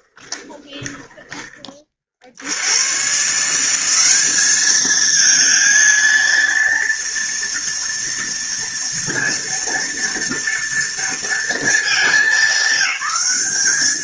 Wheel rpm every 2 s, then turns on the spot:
10, 60, 200, 230, 230, 230, 200.
0-2